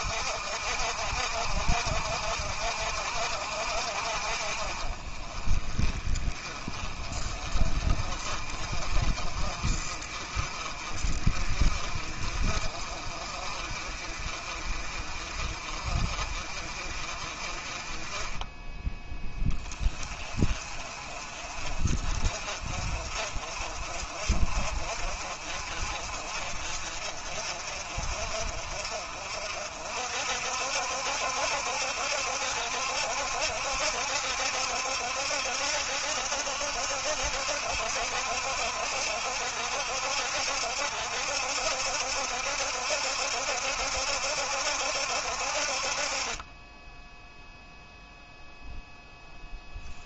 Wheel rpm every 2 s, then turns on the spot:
60, 60, 30, 30, 30, 30, 40, 30, 30, 10, 40, 40, 50, 40, 50, 70, 70, 70, 70, 70, 70, 70, 70, 10, 0.
none